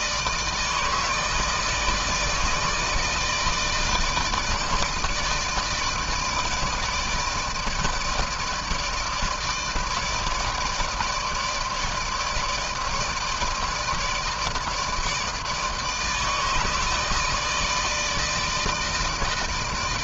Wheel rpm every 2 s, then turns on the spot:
160, 160, 160, 160, 150, 160, 160, 160, 160, 160.
none